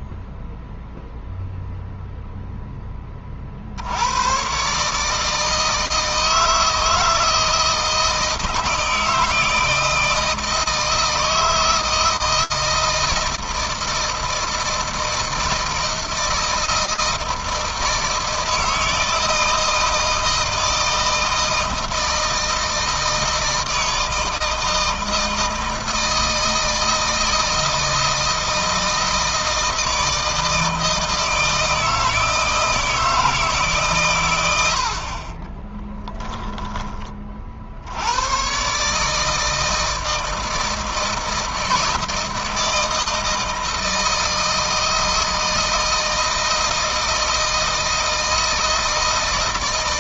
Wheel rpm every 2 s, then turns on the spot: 0, 10, 140, 160, 160, 160, 160, 160, 160, 160, 160, 160, 160, 160, 160, 160, 160, 70, 20, 140, 160, 160, 160, 160, 160.
none